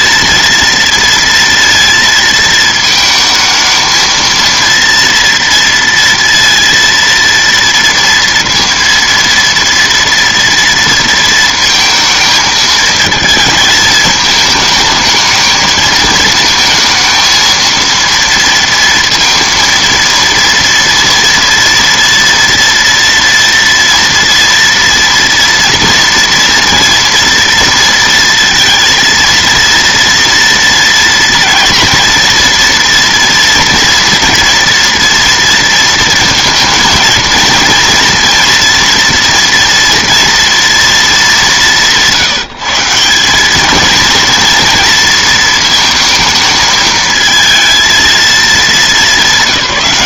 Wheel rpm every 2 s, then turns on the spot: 230, 220, 230, 230, 230, 230, 220, 220, 230, 230, 230, 230, 230, 230, 230, 230, 230, 230, 230, 240, 220, 180, 230, 220, 210.
none